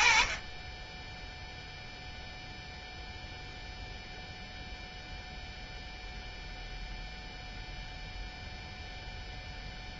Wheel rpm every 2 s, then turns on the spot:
10, 0, 0, 0, 0.
none